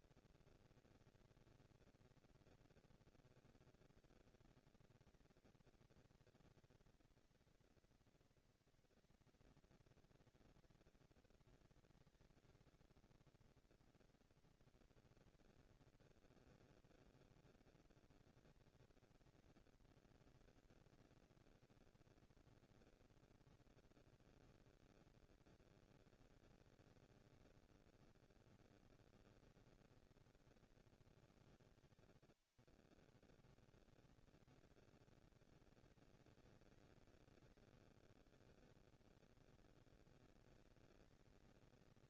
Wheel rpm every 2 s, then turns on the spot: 240, 230, 230, 230, 230, 230, 230, 230, 230, 230, 230, 230, 230, 220, 210, 170, 80, 200, 210, 190, 220.
none